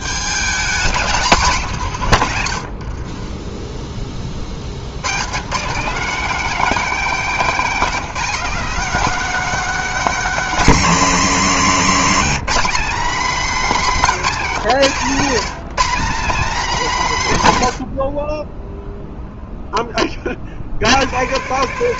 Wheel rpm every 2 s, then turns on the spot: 220, 70, 80, 260, 250, 230, 230, 180, 210, 0, 110.
none